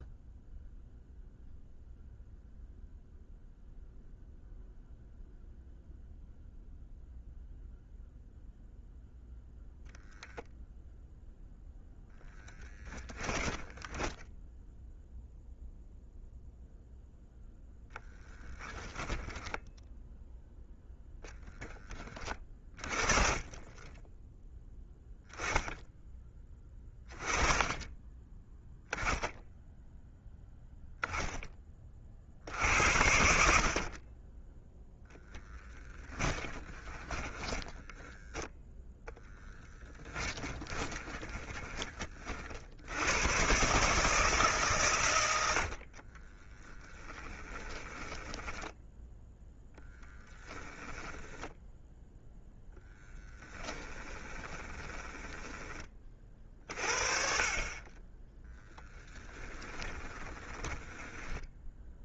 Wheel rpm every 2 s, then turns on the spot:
0, 0, 0, 0, 0, 0, 10, 0, 0, 10, 10, 30, 10, 30, 10, 0, 70, 0, 10, 0, 20, 80, 130, 20, 10, 20, 10, 20, 40, 10, 20.
12-14 18-20 36-38 40-42 46-48 50-52 54-56 58-62